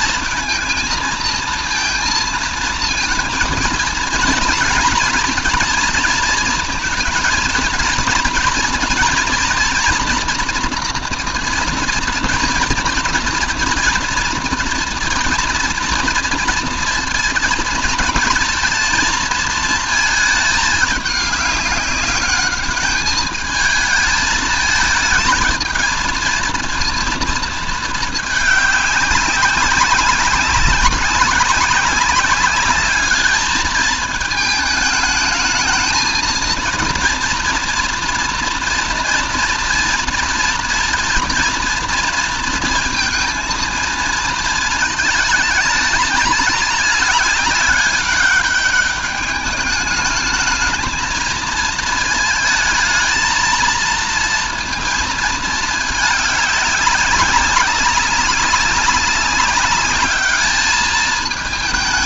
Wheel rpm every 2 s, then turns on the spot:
230, 230, 230, 220, 240, 230, 230, 230, 230, 230, 210, 200, 220, 230, 210, 200, 200, 220, 230, 230, 230, 230, 220, 210, 200, 220, 220, 230, 200, 200, 210.
none